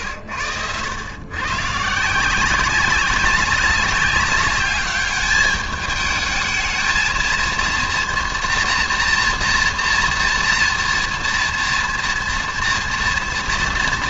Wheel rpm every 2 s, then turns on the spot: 100, 180, 200, 220, 230, 230, 230.
none